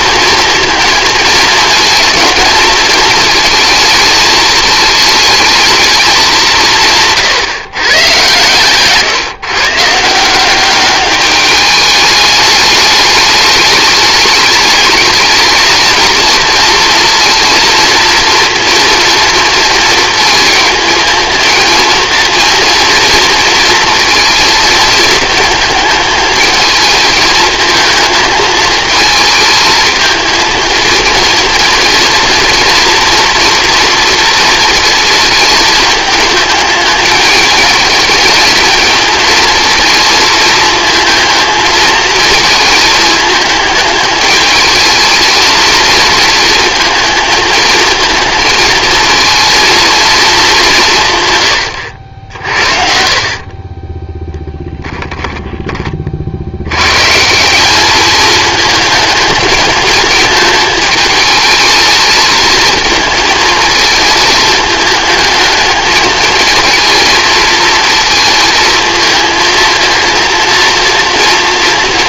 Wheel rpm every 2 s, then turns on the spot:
230, 220, 220, 180, 130, 190, 210, 210, 230, 230, 220, 230, 230, 220, 220, 230, 230, 230, 220, 220, 230, 220, 220, 230, 220, 190, 60, 10, 90, 220, 220, 220, 220, 220, 220, 230.
8-10